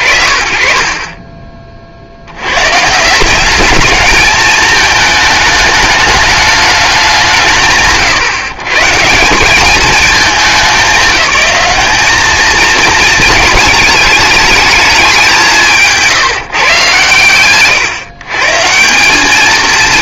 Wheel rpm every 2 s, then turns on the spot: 40, 130, 210, 190, 130, 200, 220, 210, 140, 170.
none